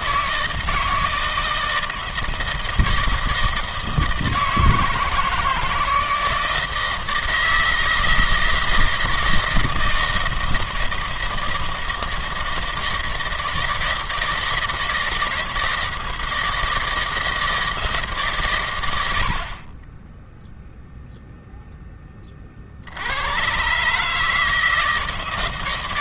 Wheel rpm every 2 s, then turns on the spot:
160, 160, 160, 160, 160, 160, 160, 160, 160, 90, 0, 70, 160.
none